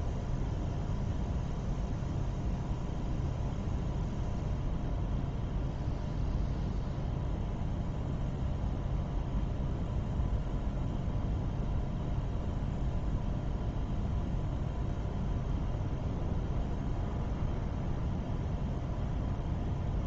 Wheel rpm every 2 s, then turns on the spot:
0, 0, 0, 0, 0, 0, 0, 0, 0, 0.
none